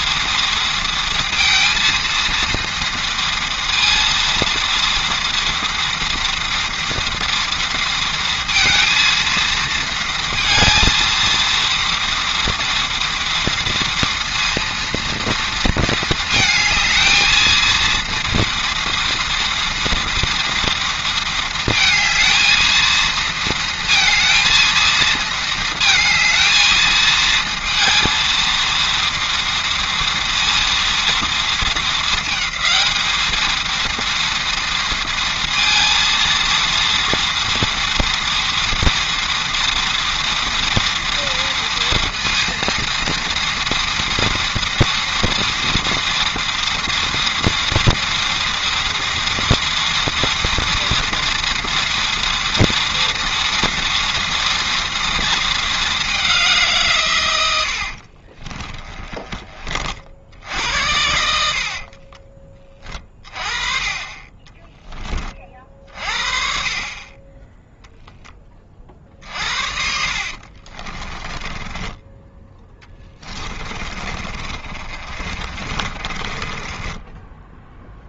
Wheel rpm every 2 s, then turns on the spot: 230, 230, 230, 230, 230, 230, 230, 230, 220, 230, 230, 230, 220, 220, 230, 230, 220, 230, 230, 230, 230, 230, 230, 230, 230, 230, 230, 230, 160, 20, 70, 30, 20, 30, 30, 30, 20, 40, 20.
58-60 70-78